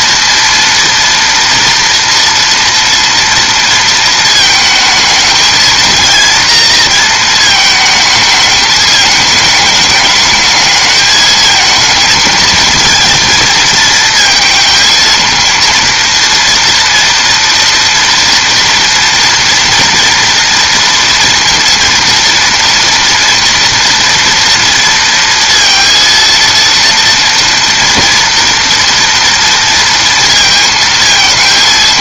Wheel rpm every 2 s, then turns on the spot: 230, 230, 220, 230, 210, 210, 220, 220, 230, 230, 230, 230, 230, 230, 230, 220.
none